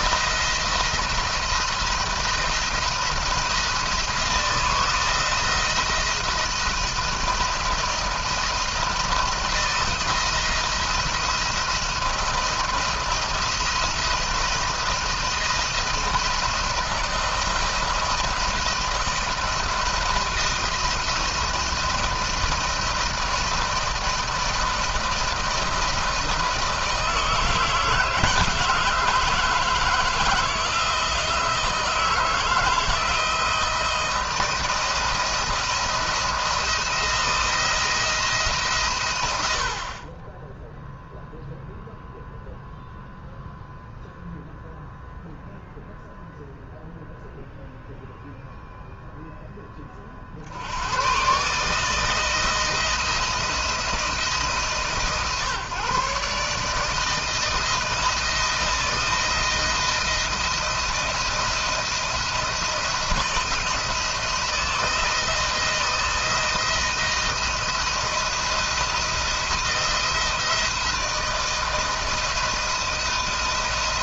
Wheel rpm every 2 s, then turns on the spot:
170, 160, 160, 160, 170, 170, 170, 160, 160, 160, 160, 170, 170, 160, 160, 160, 160, 170, 160, 130, 0, 0, 0, 0, 0, 100, 160, 140, 150, 160, 170, 170, 170, 170, 170, 160, 160.
none